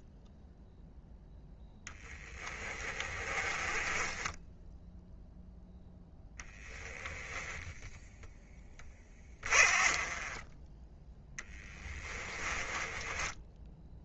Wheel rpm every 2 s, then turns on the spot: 0, 20, 10, 10, 20, 10, 20.
2-6 8-14